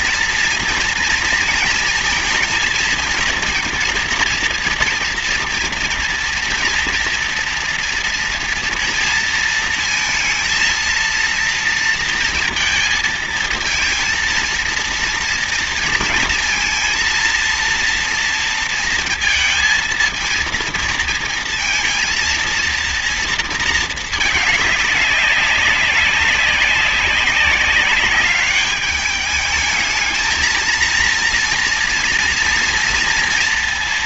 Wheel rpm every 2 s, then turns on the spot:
230, 230, 230, 230, 230, 230, 230, 230, 230, 230, 230, 230, 200, 200, 210, 230, 230.
none